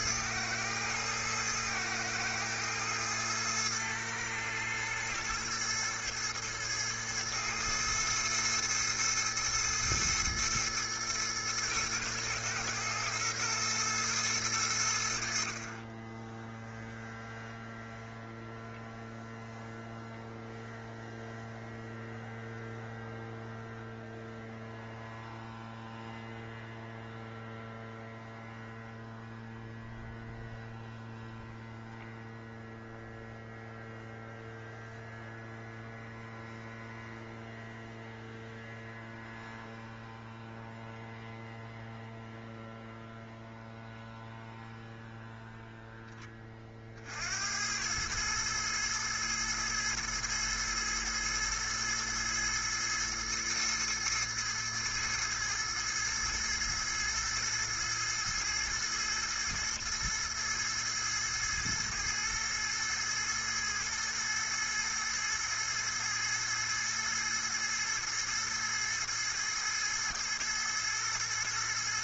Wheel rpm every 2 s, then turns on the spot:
110, 110, 110, 110, 110, 110, 110, 70, 0, 0, 0, 0, 0, 0, 0, 0, 0, 0, 0, 0, 0, 0, 0, 50, 110, 110, 110, 110, 110, 110, 110, 110, 110, 110, 110, 110.
none